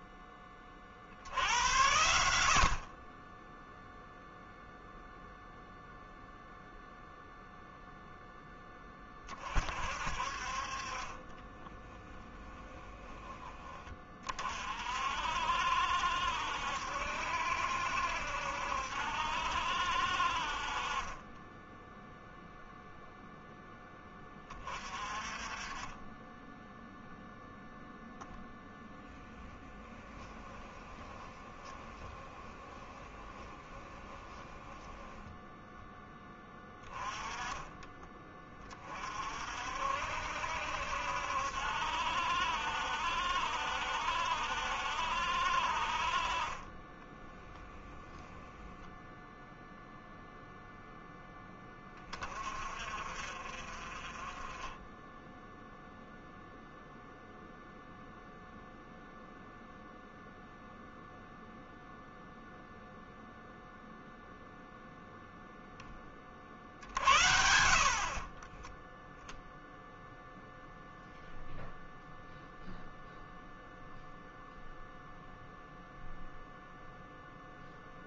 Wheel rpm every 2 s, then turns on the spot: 50, 40, 0, 0, 20, 30, 10, 50, 70, 70, 30, 0, 30, 10, 10, 10, 10, 10, 20, 30, 70, 70, 70, 20, 0, 10, 40, 10, 0, 0, 0, 0, 0, 60, 20, 0, 0, 0, 0.
28-36 46-48